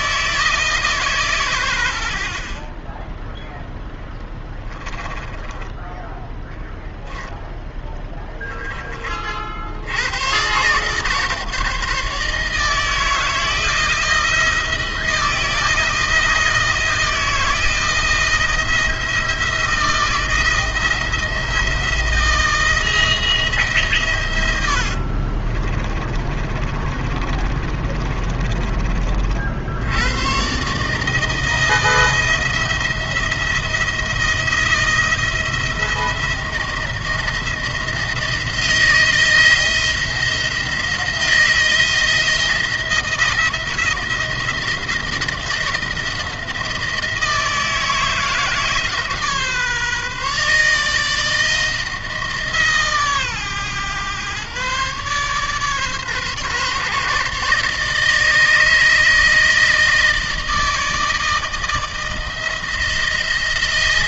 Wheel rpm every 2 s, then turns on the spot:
150, 20, 20, 10, 30, 140, 160, 170, 170, 170, 160, 170, 60, 30, 40, 150, 170, 170, 170, 160, 160, 170, 160, 160, 150, 150, 140, 140, 140, 160, 160, 160.
4-8 24-28